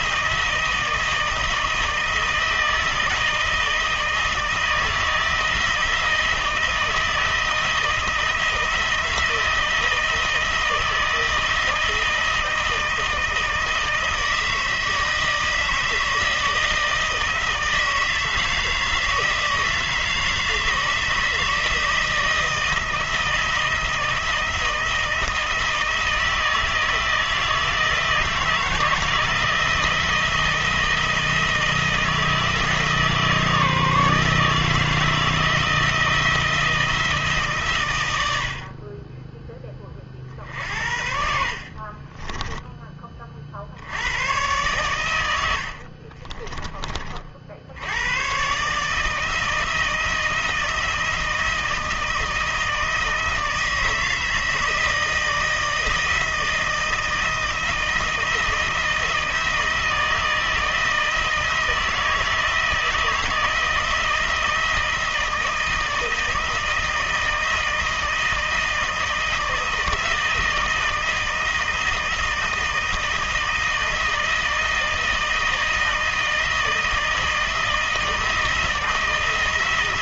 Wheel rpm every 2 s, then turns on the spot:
160, 160, 160, 160, 170, 160, 160, 160, 160, 160, 160, 160, 160, 160, 160, 170, 160, 160, 160, 40, 60, 20, 120, 30, 150, 160, 160, 160, 160, 160, 160, 160, 160, 160, 160, 160, 160, 160, 160, 160.
42-44 46-48